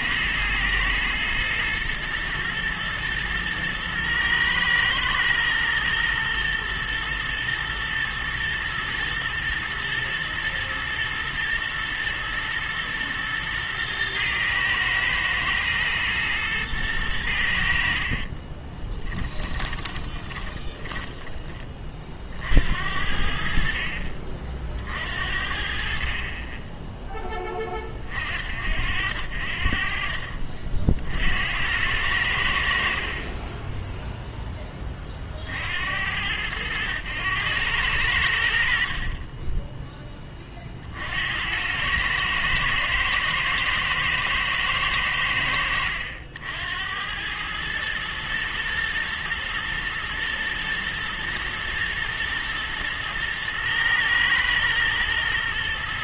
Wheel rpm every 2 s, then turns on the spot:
110, 110, 110, 110, 120, 110, 120, 110, 110, 20, 10, 70, 50, 20, 60, 50, 70, 20, 100, 50, 50, 110, 100, 90, 110, 120, 110, 110.
18-22